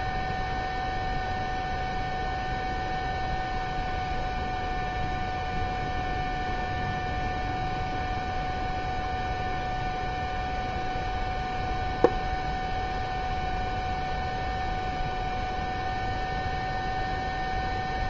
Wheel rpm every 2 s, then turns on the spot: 0, 0, 0, 0, 0, 0, 0, 0, 0.
none